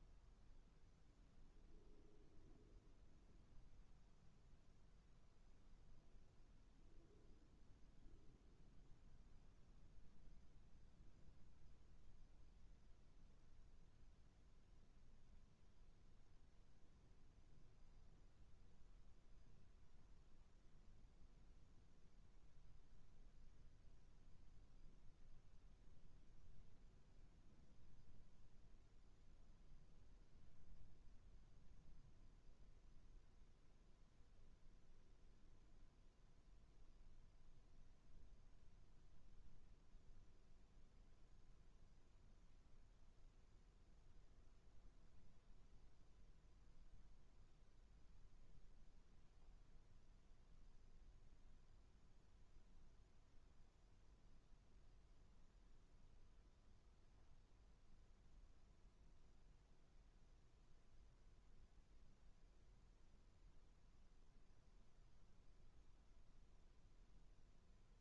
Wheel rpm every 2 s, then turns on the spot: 0, 0, 0, 0, 0, 0, 0, 0, 0, 0, 0, 0, 0, 0, 0, 0, 0, 0, 0, 0, 0, 0, 0, 0, 0, 0, 0, 0, 0, 0, 0, 0, 0, 0.
none